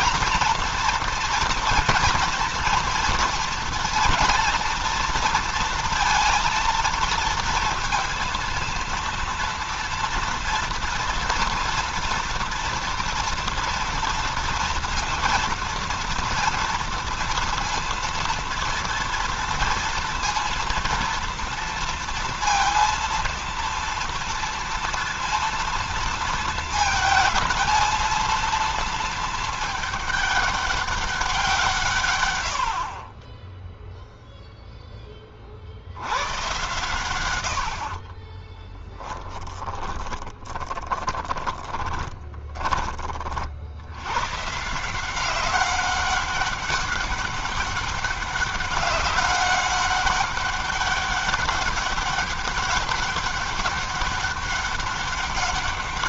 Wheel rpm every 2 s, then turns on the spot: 230, 230, 240, 230, 230, 230, 230, 230, 230, 230, 230, 230, 230, 220, 230, 200, 90, 0, 120, 30, 10, 20, 120, 200, 200, 200, 200, 200.
38-44